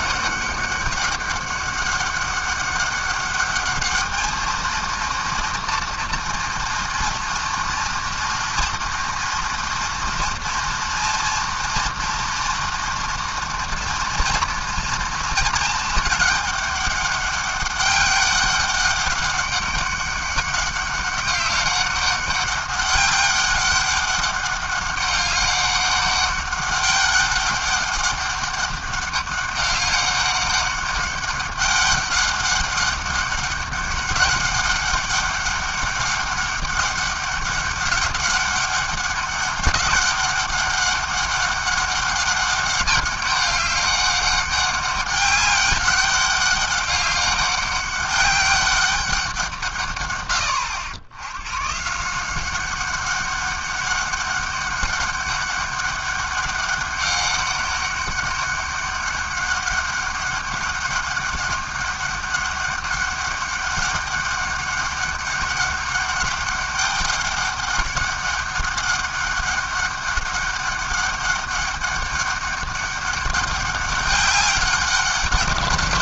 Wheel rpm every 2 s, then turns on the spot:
200, 200, 220, 230, 230, 230, 240, 230, 210, 200, 200, 200, 200, 200, 200, 200, 200, 200, 200, 200, 200, 200, 200, 200, 200, 90, 190, 200, 200, 200, 200, 200, 200, 200, 200, 200, 200, 190.
none